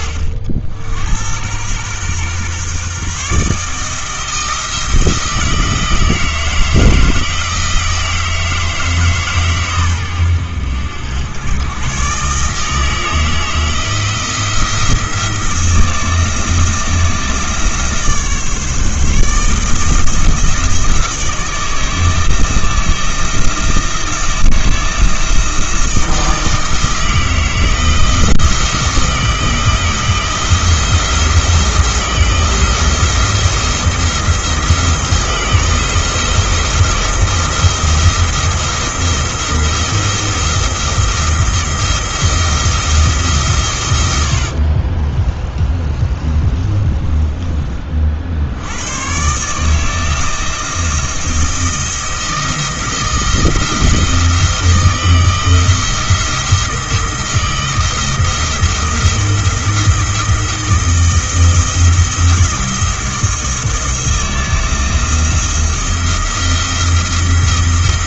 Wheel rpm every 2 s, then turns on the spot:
70, 130, 160, 160, 160, 90, 160, 170, 160, 150, 160, 170, 170, 160, 170, 170, 170, 170, 170, 170, 170, 170, 50, 30, 100, 170, 160, 160, 170, 170, 170, 170, 160, 170.
44-48